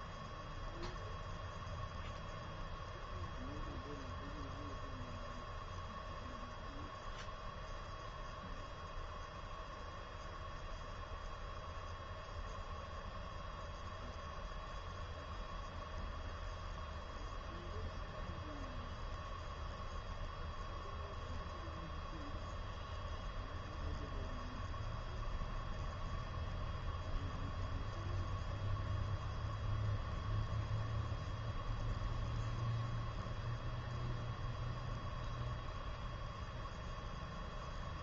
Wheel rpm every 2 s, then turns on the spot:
0, 0, 0, 0, 0, 0, 0, 0, 0, 0, 0, 0, 0, 0, 0, 0, 0, 0, 0.
none